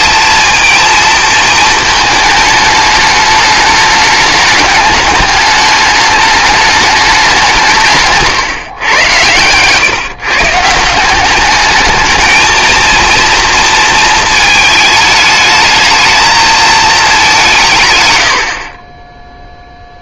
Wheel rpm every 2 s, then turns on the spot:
230, 210, 210, 210, 120, 160, 230, 220, 220, 40.
none